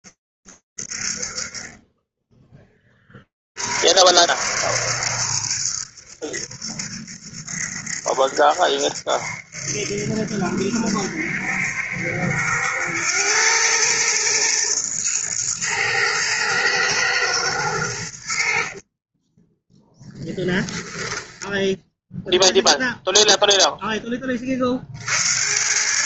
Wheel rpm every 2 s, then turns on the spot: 60, 70, 70, 70, 70, 110, 110, 90, 10, 0, 0, 90, 110.
none